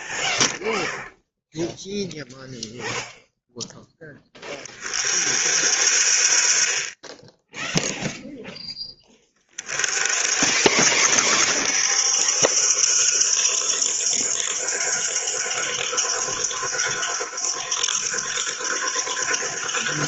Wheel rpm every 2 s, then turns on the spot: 0, 0, 40, 30, 10, 60, 80, 90, 90, 90.
none